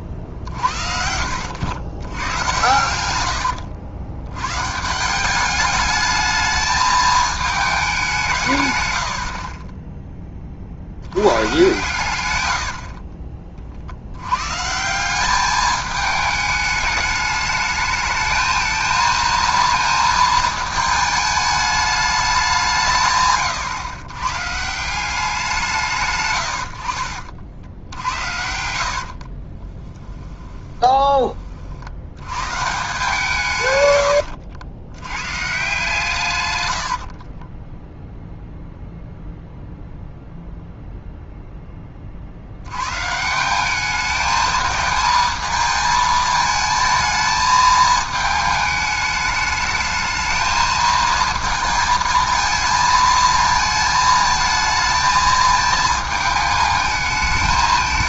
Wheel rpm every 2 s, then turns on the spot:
40, 110, 140, 220, 120, 50, 70, 150, 210, 220, 220, 170, 160, 80, 70, 20, 140, 100, 90, 0, 0, 100, 220, 220, 210, 220, 220, 220, 220.
12-14 28-32 36-38